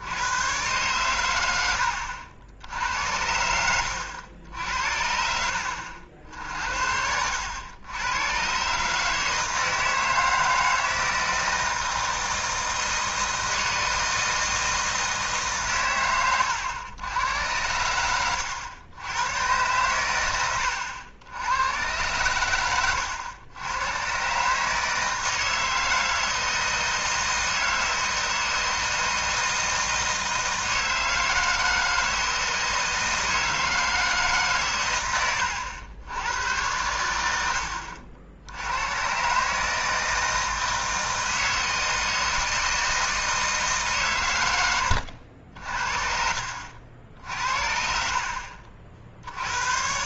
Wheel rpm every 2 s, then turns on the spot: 110, 70, 80, 70, 140, 160, 160, 160, 100, 90, 100, 100, 150, 160, 160, 160, 160, 120, 90, 90, 160, 160, 100, 70, 50.
20-22